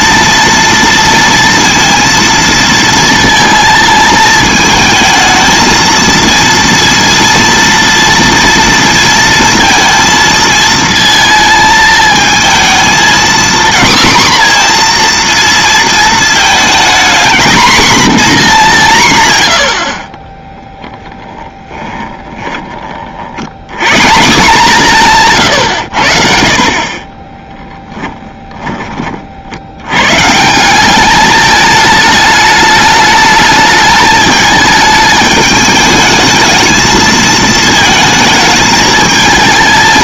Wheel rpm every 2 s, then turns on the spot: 230, 230, 220, 230, 230, 220, 230, 240, 230, 190, 10, 20, 150, 40, 20, 190, 210, 210, 220, 220.
20-22